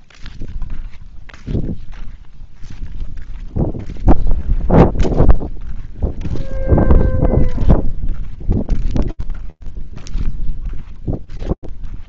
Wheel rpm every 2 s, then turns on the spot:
0, 0, 0, 0, 0, 0.
none